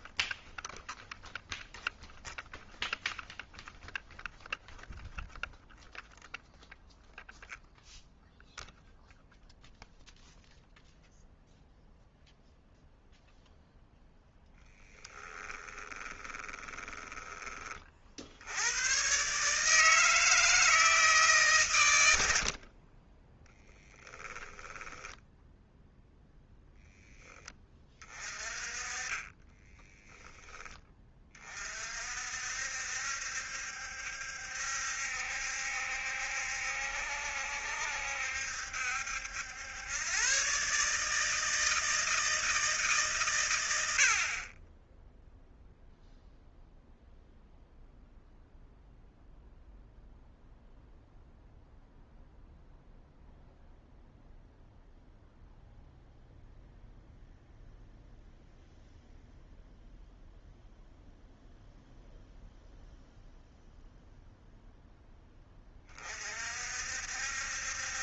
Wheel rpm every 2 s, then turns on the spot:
0, 0, 0, 0, 0, 0, 0, 10, 20, 110, 160, 30, 10, 10, 30, 20, 70, 70, 70, 70, 150, 160, 10, 0, 0, 0, 0, 0, 0, 0, 0, 0, 0, 60.
14-18 22-24